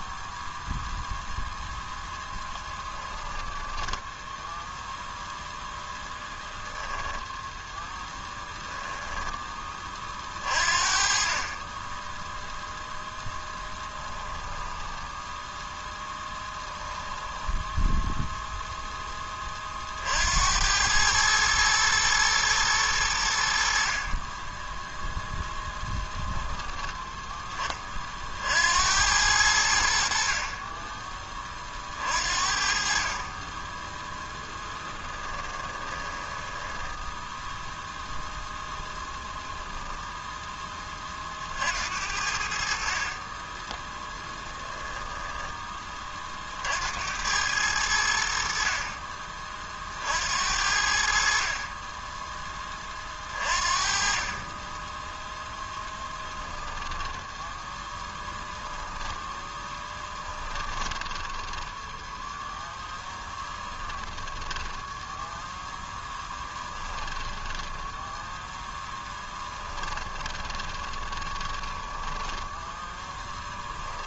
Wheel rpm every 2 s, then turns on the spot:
0, 20, 0, 10, 10, 40, 0, 10, 10, 0, 100, 100, 0, 10, 80, 20, 40, 10, 10, 10, 30, 40, 10, 70, 40, 60, 30, 10, 10, 10, 10, 0, 10, 10, 10, 20, 10.
2-4 16-18 34-38 58-62 64-74